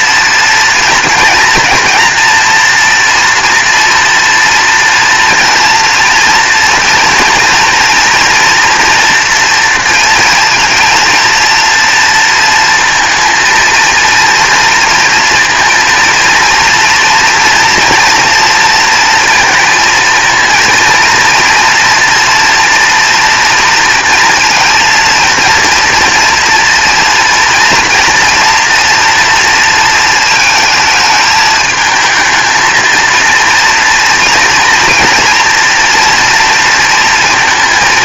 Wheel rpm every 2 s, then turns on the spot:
230, 230, 230, 230, 230, 230, 230, 230, 230, 230, 230, 240, 230, 230, 230, 220, 230, 230, 230.
none